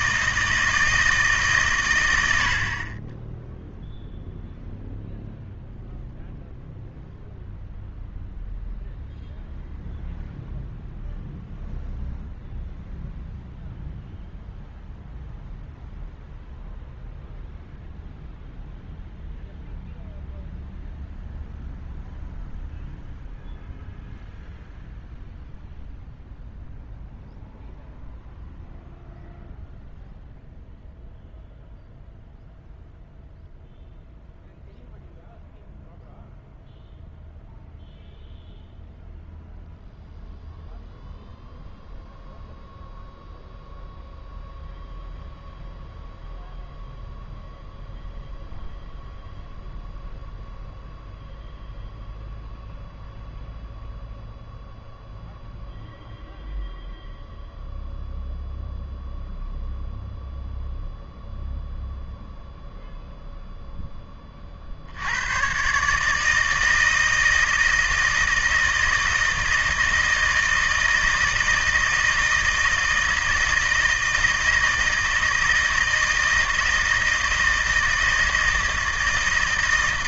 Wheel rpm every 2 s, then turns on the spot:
160, 30, 0, 0, 0, 0, 0, 0, 0, 0, 0, 0, 0, 0, 0, 0, 0, 0, 0, 0, 0, 0, 0, 0, 0, 0, 0, 0, 0, 0, 0, 0, 70, 160, 160, 160, 160, 160, 160, 160.
none